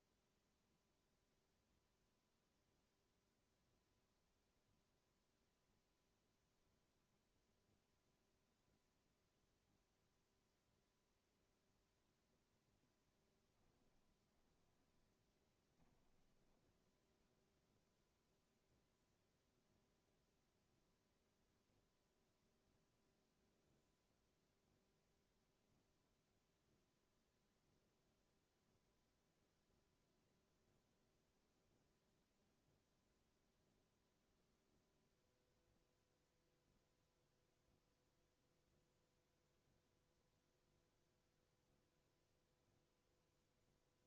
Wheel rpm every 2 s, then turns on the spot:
0, 0, 0, 0, 0, 0, 0, 10, 20, 0, 0, 0, 0, 0, 0, 0, 0, 0, 0, 0, 0, 0.
14-18